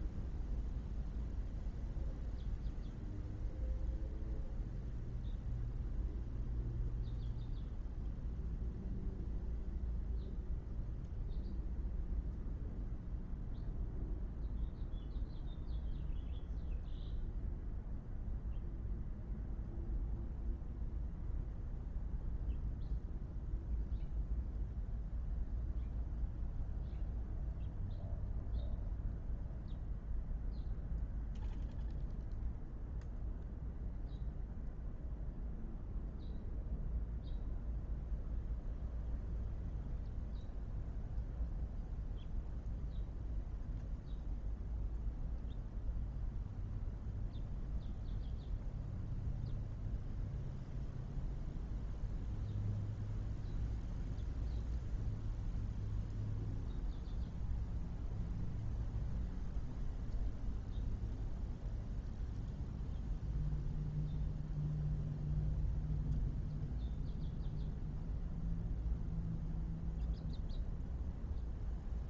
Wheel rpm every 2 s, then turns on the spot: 0, 0, 0, 0, 0, 0, 0, 0, 0, 0, 0, 0, 0, 0, 0, 0, 0, 0, 0, 0, 0, 0, 0, 0, 0, 0, 0, 0, 0, 0, 0, 0, 0, 0, 0, 0.
none